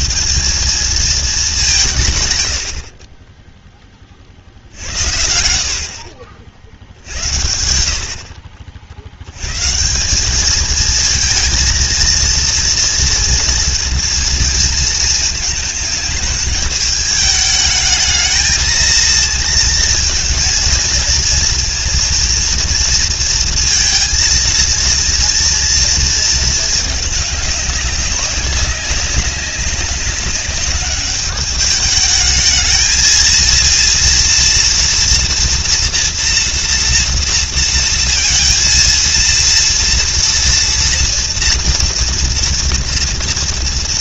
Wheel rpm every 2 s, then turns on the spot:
190, 60, 70, 70, 60, 220, 230, 220, 210, 220, 230, 230, 230, 220, 200, 200, 220, 230, 230, 230, 240, 230.
none